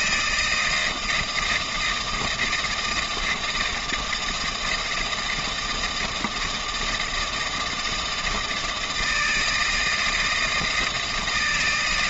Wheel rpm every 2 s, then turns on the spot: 160, 160, 160, 160, 160, 160.
none